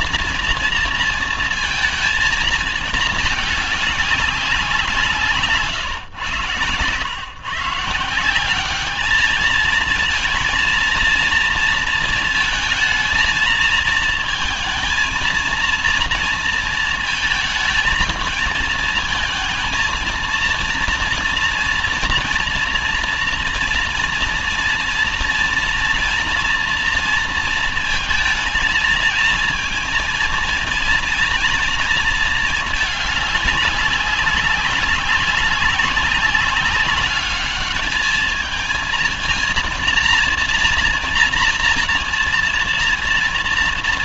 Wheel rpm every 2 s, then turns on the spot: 230, 220, 190, 120, 190, 230, 230, 220, 230, 220, 230, 240, 230, 230, 220, 230, 220, 200, 200, 220, 230, 230.
none